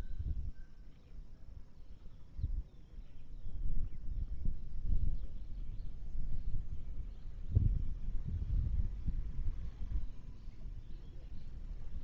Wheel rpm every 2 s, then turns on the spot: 0, 0, 0, 0, 0, 0.
none